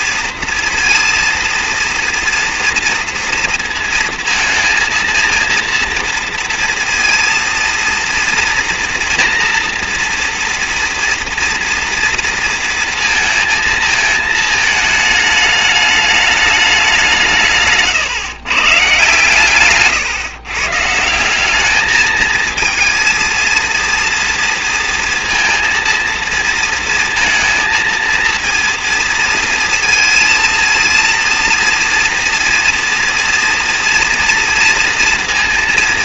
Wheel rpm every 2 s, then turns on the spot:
230, 230, 230, 230, 230, 240, 230, 220, 200, 130, 140, 230, 230, 230, 230, 230, 230, 230.
none